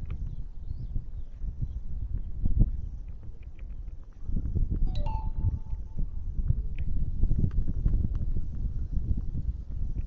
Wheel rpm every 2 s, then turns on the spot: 0, 0, 0, 0, 0.
none